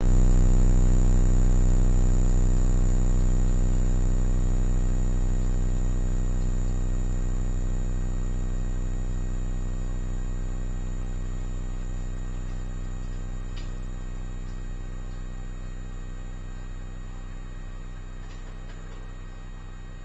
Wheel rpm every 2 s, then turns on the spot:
0, 0, 0, 0, 0, 0, 0, 0, 0, 0.
none